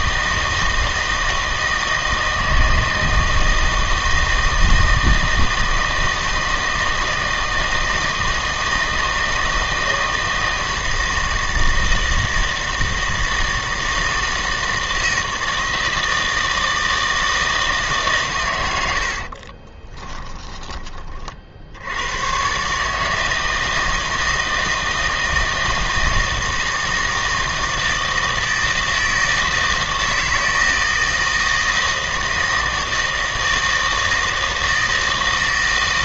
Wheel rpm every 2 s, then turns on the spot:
160, 160, 160, 160, 160, 160, 160, 160, 160, 90, 30, 150, 160, 160, 160, 160, 160, 160.
18-20